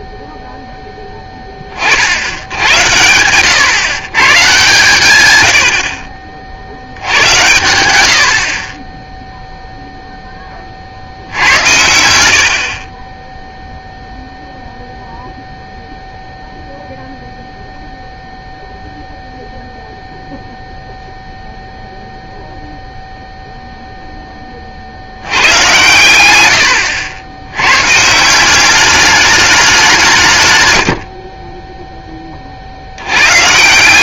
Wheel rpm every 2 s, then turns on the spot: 0, 90, 140, 60, 30, 20, 60, 0, 0, 0, 0, 0, 30, 110, 180, 130, 20.
none